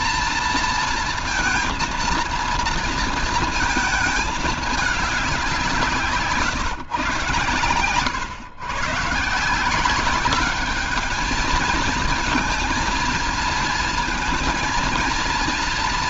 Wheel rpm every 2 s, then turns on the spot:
230, 230, 220, 150, 120, 200, 230, 230.
none